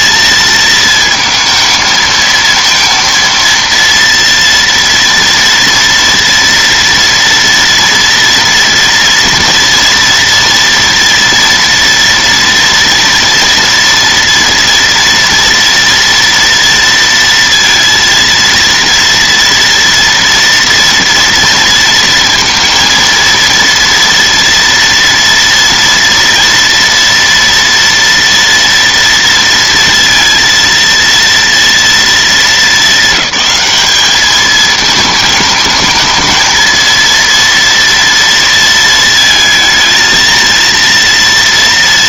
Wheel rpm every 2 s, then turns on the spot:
230, 230, 230, 230, 230, 240, 230, 230, 230, 230, 230, 230, 230, 230, 230, 230, 210, 210, 220, 230, 230.
none